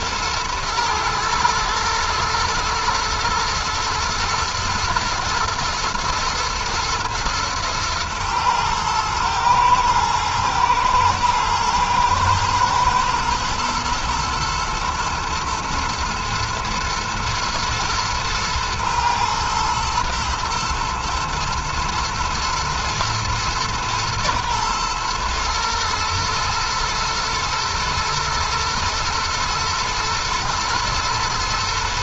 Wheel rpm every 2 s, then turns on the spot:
110, 120, 120, 110, 110, 120, 110, 110, 110, 110, 120, 110, 120, 110, 120, 110.
none